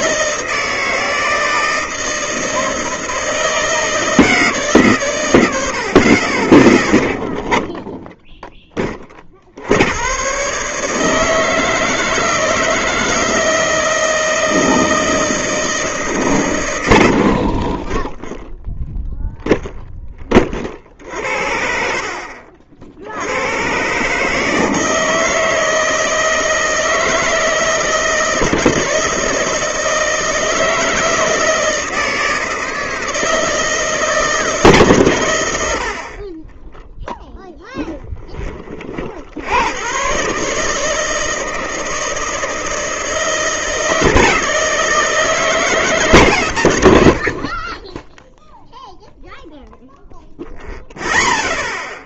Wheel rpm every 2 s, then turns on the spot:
160, 160, 150, 30, 10, 140, 160, 160, 110, 0, 40, 50, 160, 160, 150, 160, 160, 150, 20, 30, 140, 160, 160, 120, 0, 0.
none